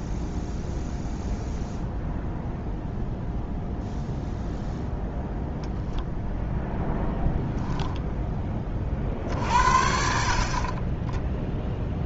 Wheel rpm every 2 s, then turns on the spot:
0, 0, 0, 0, 30, 20.
none